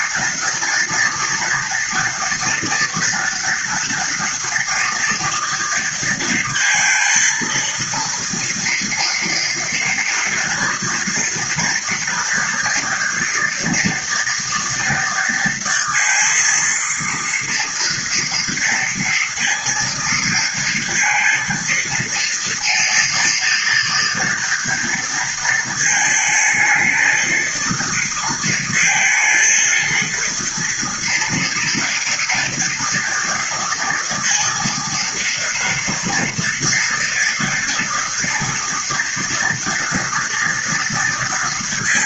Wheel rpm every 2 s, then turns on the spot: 230, 230, 230, 230, 230, 230, 230, 230, 230, 230, 230, 230, 230, 220, 230, 230, 230, 230, 240, 230, 230.
none